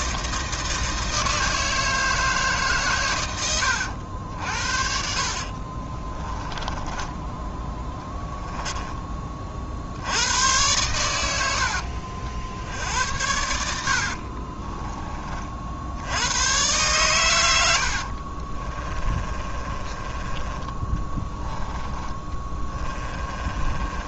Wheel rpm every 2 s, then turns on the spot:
160, 140, 60, 10, 10, 100, 70, 30, 120, 30, 20, 20.
6-8 14-16 18-20 22-24